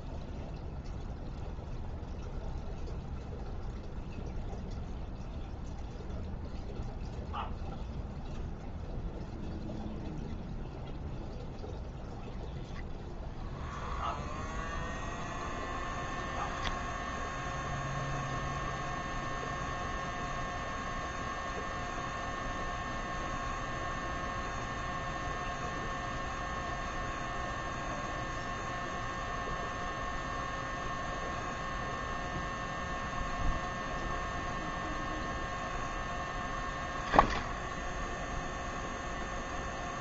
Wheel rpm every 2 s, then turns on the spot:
0, 0, 0, 0, 0, 0, 0, 0, 10, 0, 0, 0, 0, 0, 0, 0, 0, 0, 10, 0.
none